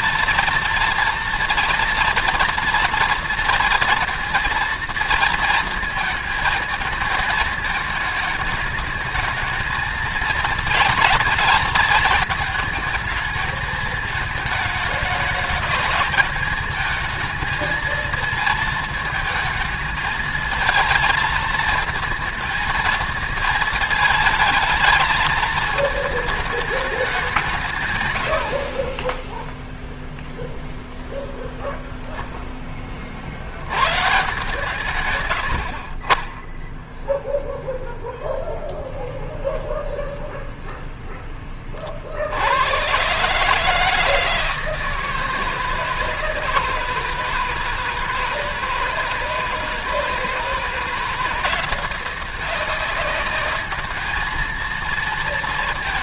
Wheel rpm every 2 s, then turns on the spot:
230, 230, 230, 220, 220, 230, 220, 210, 220, 220, 220, 220, 220, 210, 40, 0, 20, 130, 10, 0, 0, 90, 160, 160, 160, 160, 180, 220.
none